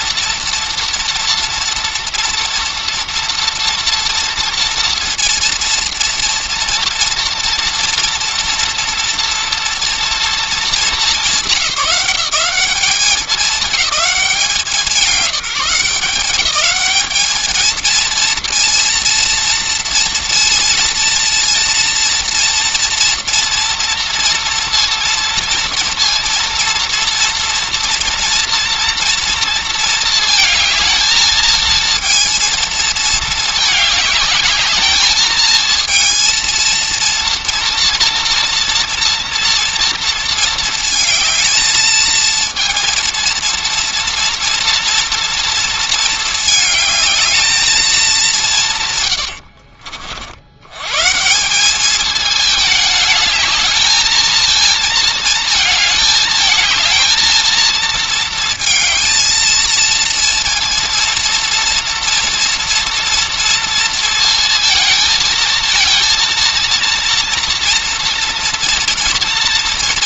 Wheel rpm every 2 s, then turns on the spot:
230, 230, 230, 230, 230, 210, 190, 180, 200, 230, 230, 240, 230, 230, 230, 220, 230, 210, 230, 230, 220, 230, 230, 210, 130, 90, 210, 230, 220, 230, 230, 230, 230, 230, 230.
none